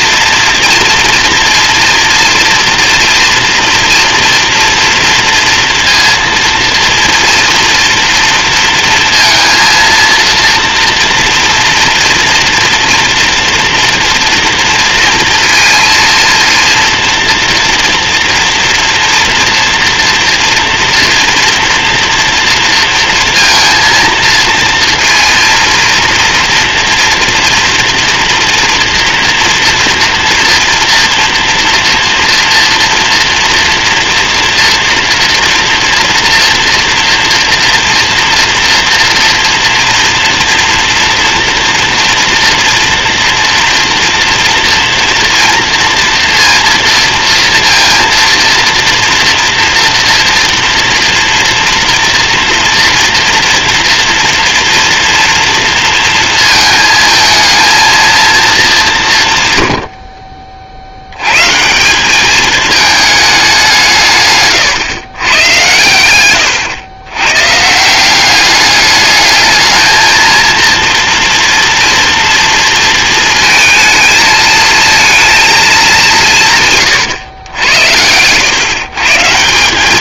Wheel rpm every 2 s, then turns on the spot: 230, 240, 230, 230, 230, 240, 240, 230, 230, 230, 230, 230, 230, 230, 230, 230, 230, 230, 230, 230, 230, 230, 230, 230, 230, 230, 240, 230, 230, 200, 60, 210, 120, 110, 200, 230, 230, 220, 140, 130.
none